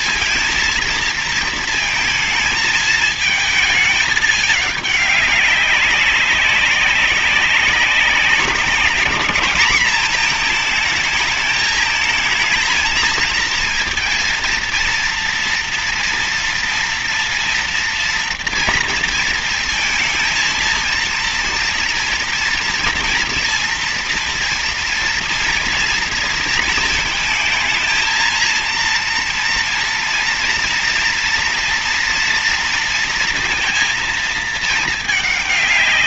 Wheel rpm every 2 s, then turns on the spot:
230, 220, 210, 190, 190, 220, 220, 230, 230, 230, 230, 230, 230, 230, 230, 230, 230, 220.
none